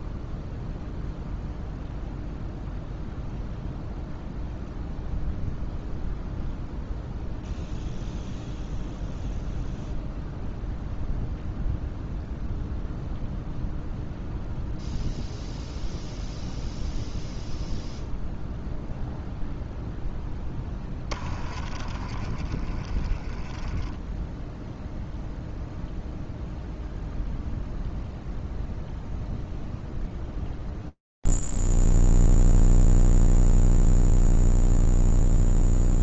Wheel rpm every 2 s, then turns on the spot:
0, 0, 0, 0, 0, 0, 0, 0, 0, 0, 10, 20, 0, 0, 0, 0, 0, 0.
20-24